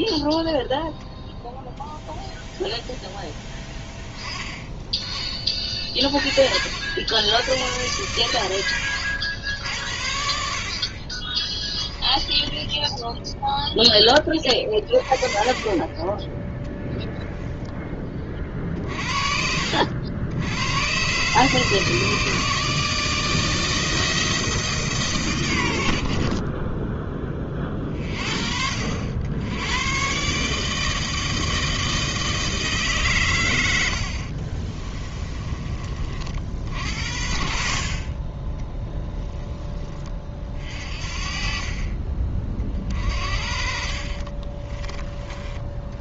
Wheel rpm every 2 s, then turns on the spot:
0, 0, 20, 60, 100, 40, 10, 20, 0, 50, 110, 160, 150, 10, 60, 160, 140, 20, 60, 10, 40, 40, 20.
8-10 12-14 34-36 38-40